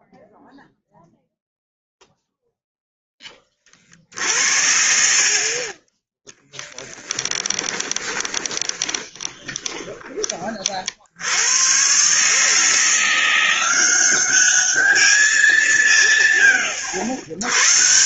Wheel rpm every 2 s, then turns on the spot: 0, 20, 50, 10, 20, 80, 170, 200, 80.
4-10